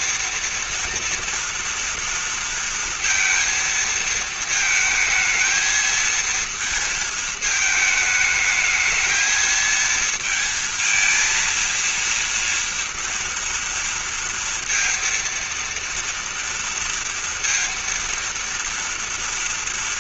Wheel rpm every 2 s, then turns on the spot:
230, 230, 220, 230, 220, 230, 230, 230, 230, 230.
none